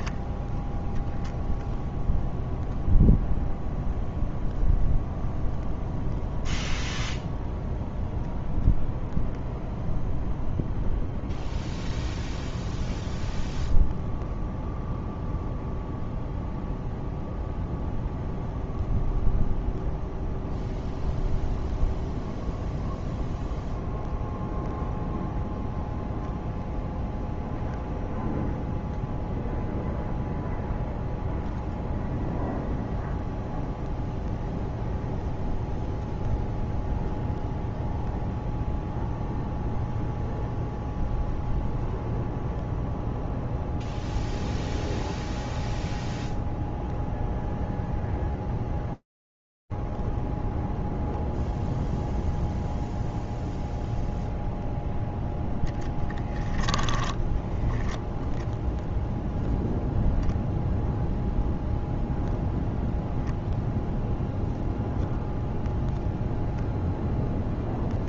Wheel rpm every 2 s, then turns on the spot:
0, 0, 0, 0, 0, 0, 0, 0, 0, 0, 0, 0, 0, 0, 0, 0, 0, 0, 0, 0, 0, 0, 0, 0, 0, 0, 0, 0, 10, 0, 0, 0, 0, 0.
56-58